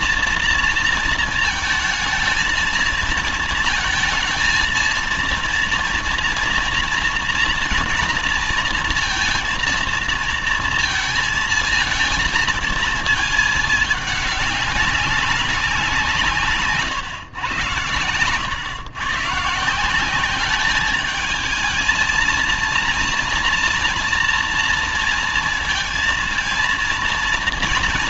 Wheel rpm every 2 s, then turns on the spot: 230, 230, 230, 230, 230, 230, 230, 200, 140, 120, 200, 230, 230, 230.
none